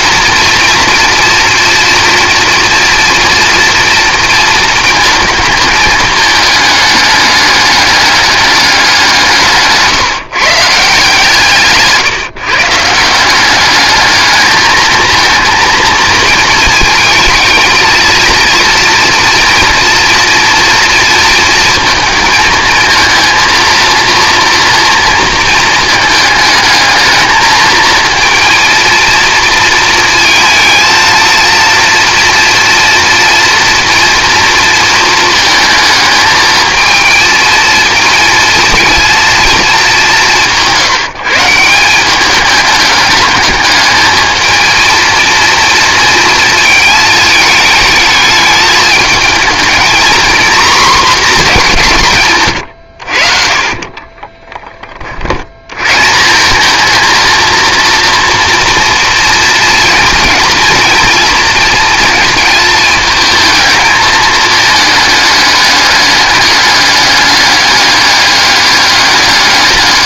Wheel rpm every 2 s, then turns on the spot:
230, 240, 230, 210, 190, 150, 160, 220, 220, 230, 230, 230, 230, 220, 230, 230, 230, 230, 220, 230, 170, 210, 230, 220, 210, 240, 90, 30, 220, 230, 230, 220, 220, 200, 200.
52-54